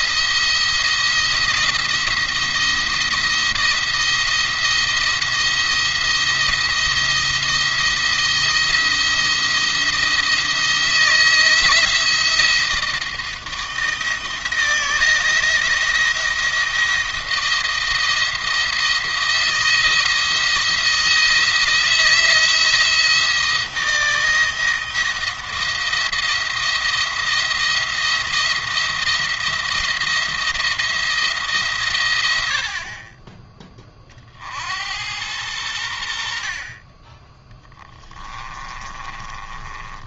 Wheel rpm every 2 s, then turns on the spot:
170, 170, 170, 170, 160, 170, 170, 170, 170, 170, 170, 170, 170, 170, 170, 170, 60, 60, 40, 20.
38-40